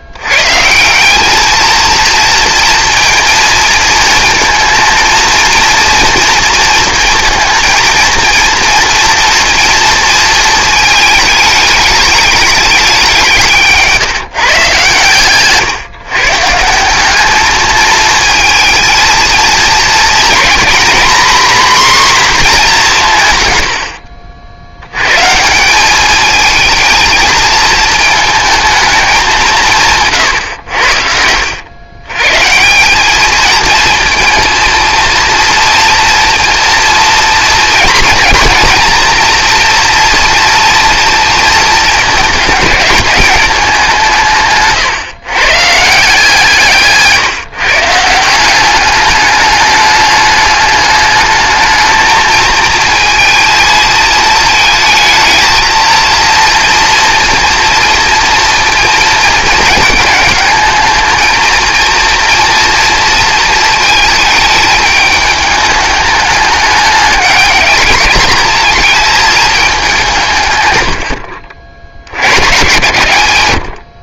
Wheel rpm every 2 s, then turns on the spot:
140, 230, 220, 230, 230, 220, 210, 150, 150, 220, 240, 230, 70, 220, 220, 110, 140, 230, 230, 230, 230, 210, 140, 150, 180, 210, 220, 220, 230, 230, 220, 230, 220, 210, 210, 130, 110.
none